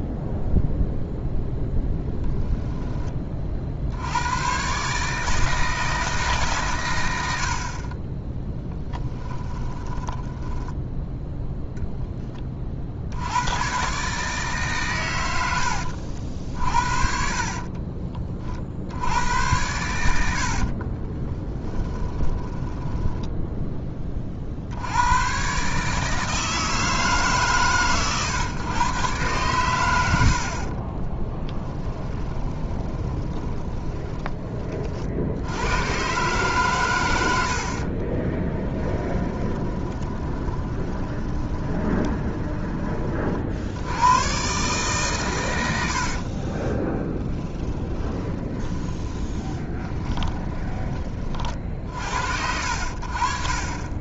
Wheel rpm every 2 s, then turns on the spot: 0, 10, 130, 130, 10, 10, 50, 140, 60, 50, 50, 10, 70, 160, 120, 40, 20, 40, 120, 20, 20, 20, 130, 20, 20, 20, 70.
8-10 20-22 30-34 38-42 46-50